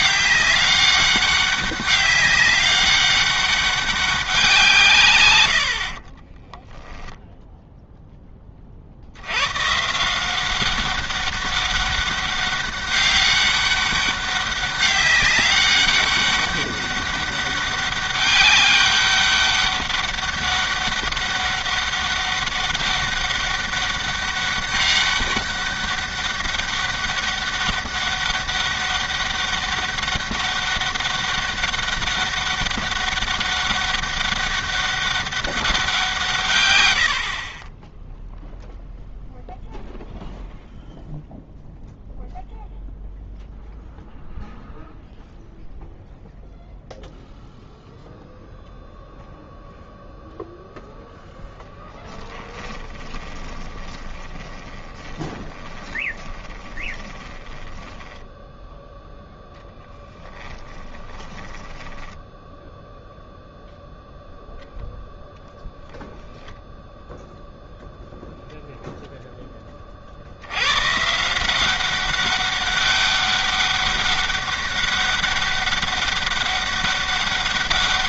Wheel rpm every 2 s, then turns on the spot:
200, 200, 160, 0, 40, 190, 200, 200, 200, 200, 200, 200, 200, 200, 200, 200, 200, 200, 130, 0, 0, 0, 0, 0, 0, 0, 10, 10, 20, 0, 10, 0, 0, 0, 0, 110, 200, 200, 200.
52-58 60-62